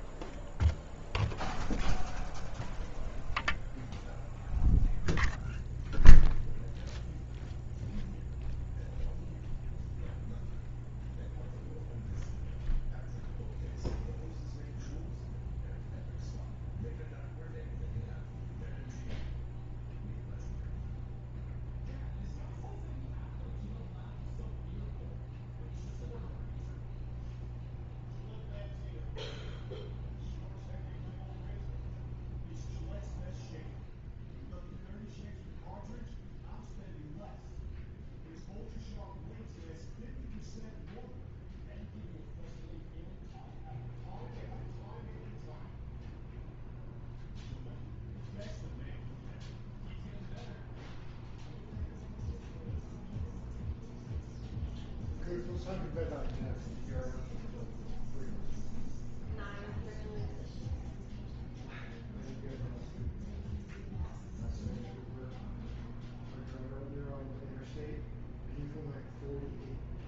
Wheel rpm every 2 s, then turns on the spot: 0, 0, 0, 0, 0, 0, 0, 0, 0, 0, 0, 0, 0, 0, 0, 0, 0, 0, 0, 0, 0, 0, 0, 0, 0, 0, 0, 0, 0, 0, 0, 0, 0, 0, 0.
none